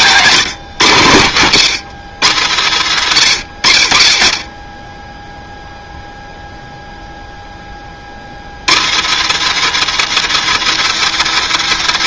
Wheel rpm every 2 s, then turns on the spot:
130, 90, 20, 0, 90, 170.
none